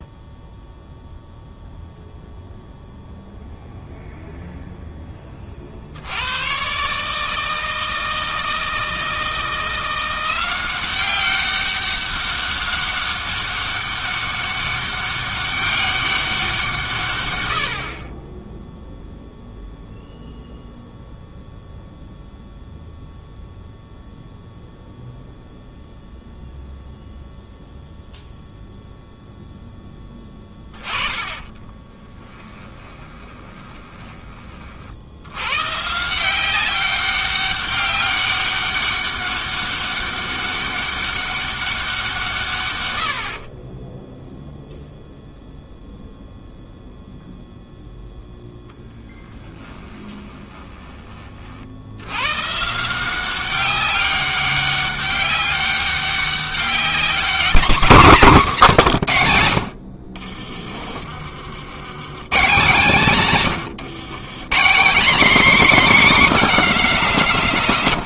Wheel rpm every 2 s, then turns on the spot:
0, 0, 0, 90, 160, 180, 200, 200, 190, 20, 0, 0, 0, 0, 0, 20, 20, 20, 170, 200, 200, 160, 0, 0, 0, 20, 110, 200, 200, 170, 50, 130, 140, 270.
32-34 50-52